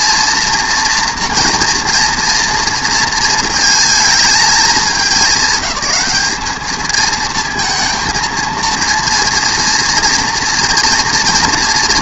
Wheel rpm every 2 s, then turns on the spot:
240, 230, 220, 220, 230, 230.
none